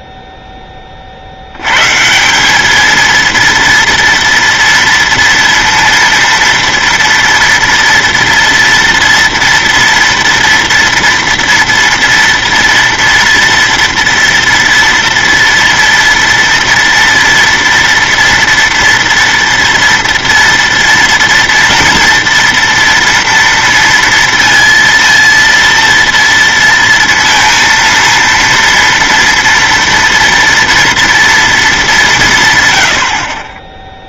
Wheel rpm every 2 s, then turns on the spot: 20, 200, 230, 230, 230, 230, 230, 230, 230, 230, 230, 230, 230, 230, 230, 230, 140.
none